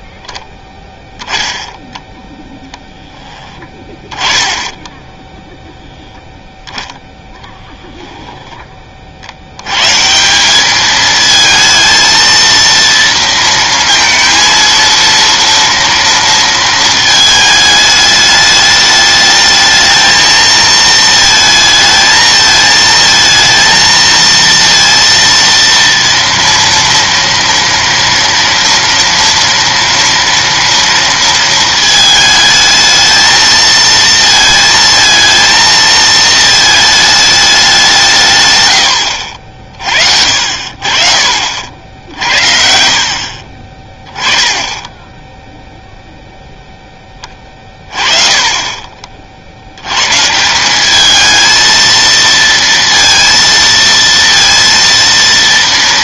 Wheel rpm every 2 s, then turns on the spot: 10, 10, 10, 0, 40, 220, 230, 230, 220, 210, 220, 220, 230, 230, 230, 230, 220, 230, 220, 70, 50, 60, 10, 0, 30, 170, 230, 230.
4-6 42-46